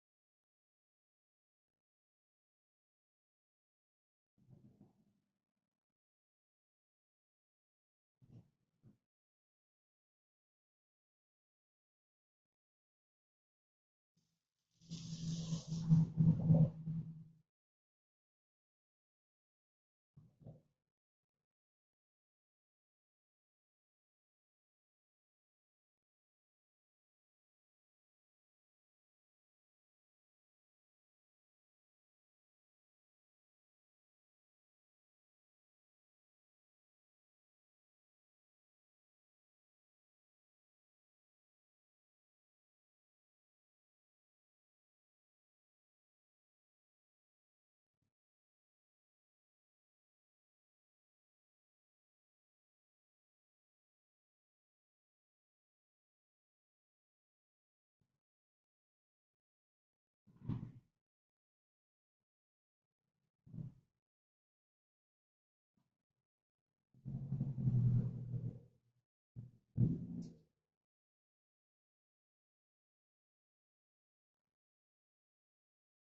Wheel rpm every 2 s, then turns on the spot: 0, 0, 0, 0, 0, 0, 0, 0, 0, 0, 0, 0, 0, 0, 0, 0, 0, 0, 0, 0, 0, 0, 0, 0, 0, 0, 0, 0, 0, 0, 0, 0, 0, 0, 0, 0, 0, 0.
none